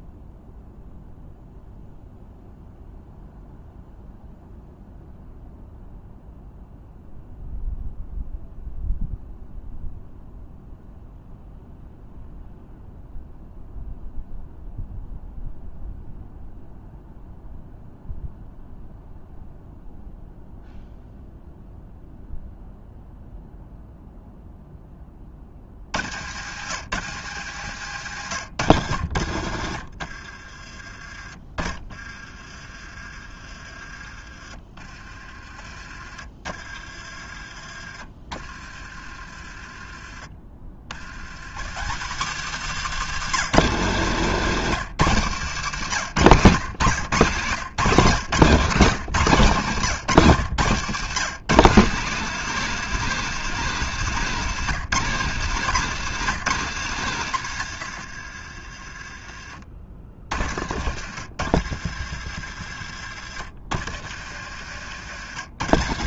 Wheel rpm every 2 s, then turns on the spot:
0, 0, 0, 0, 0, 0, 0, 0, 0, 0, 0, 0, 10, 90, 70, 30, 30, 30, 40, 40, 60, 160, 150, 110, 150, 140, 210, 170, 130, 30, 60, 60, 90.
28-30